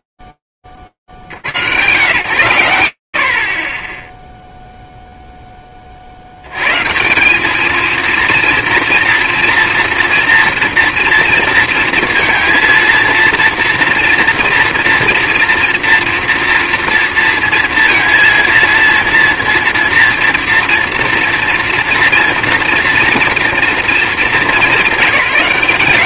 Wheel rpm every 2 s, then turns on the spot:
0, 100, 0, 70, 230, 230, 230, 230, 230, 230, 230, 230, 210.
none